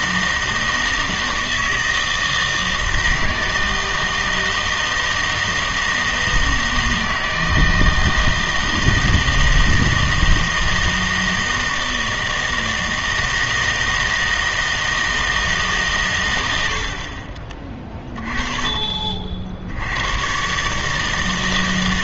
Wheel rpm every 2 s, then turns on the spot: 160, 160, 160, 160, 160, 160, 160, 160, 80, 30, 140.
none